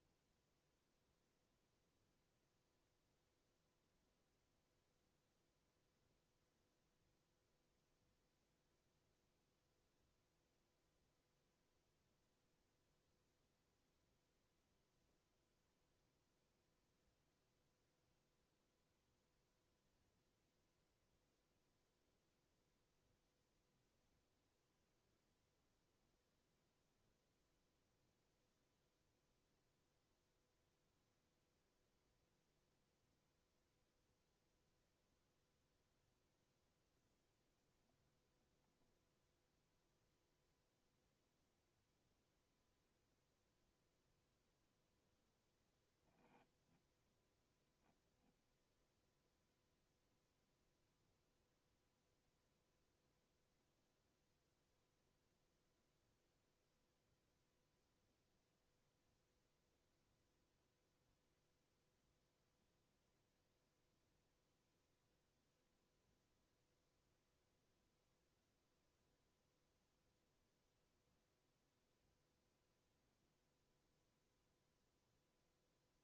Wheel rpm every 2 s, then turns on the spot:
0, 0, 0, 0, 0, 0, 0, 0, 0, 0, 0, 0, 0, 0, 0, 0, 0, 0, 0, 0, 0, 0, 0, 0, 0, 0, 0, 0, 0, 0, 0, 0, 0, 0, 0, 0, 0, 0.
none